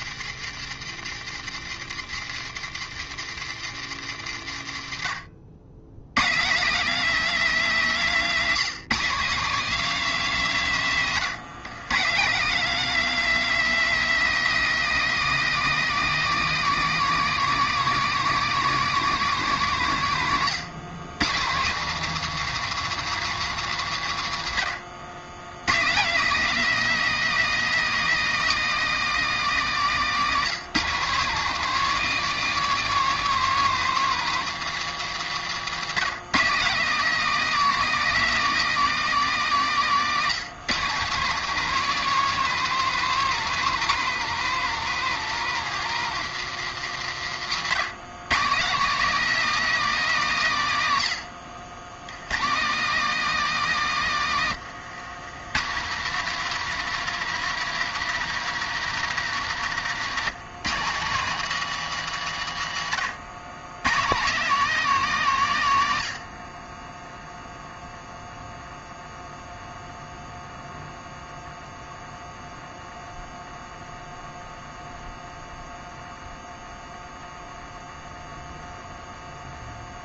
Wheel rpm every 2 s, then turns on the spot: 140, 140, 90, 200, 220, 190, 210, 220, 220, 210, 150, 210, 120, 250, 230, 190, 250, 190, 200, 230, 180, 240, 200, 140, 200, 160, 170, 130, 210, 210, 160, 120, 200, 40, 0, 0, 0, 0, 0, 0.
20-22 54-56 62-64